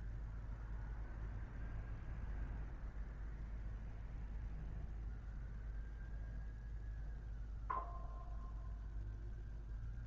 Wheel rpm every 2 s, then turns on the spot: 0, 0, 0, 0, 0.
none